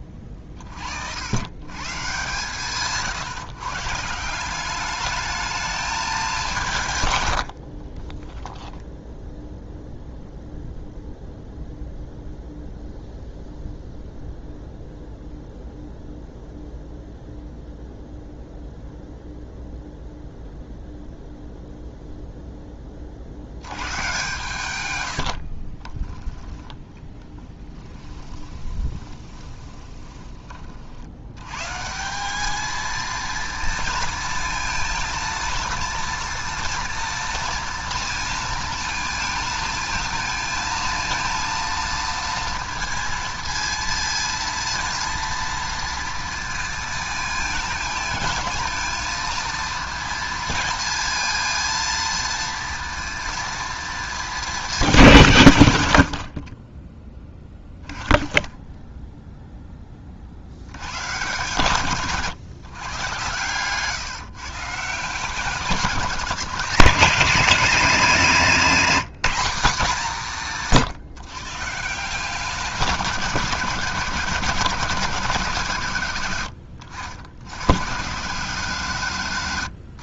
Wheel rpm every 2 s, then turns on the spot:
60, 150, 200, 160, 0, 0, 0, 0, 0, 0, 0, 20, 100, 10, 20, 50, 220, 230, 230, 220, 230, 230, 230, 230, 230, 230, 230, 220, 30, 0, 110, 130, 150, 200, 210, 170, 170, 150, 90, 160.
26-30 56-58